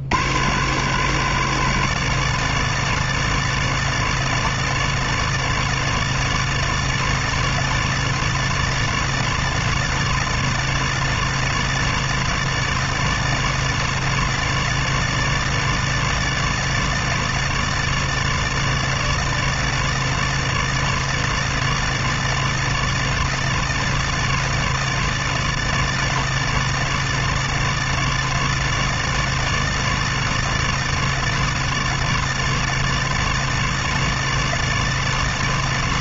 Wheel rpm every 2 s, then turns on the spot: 40, 80, 80, 80, 80, 80, 80, 80, 80, 80, 80, 80, 80, 80, 80, 80, 80, 80.
none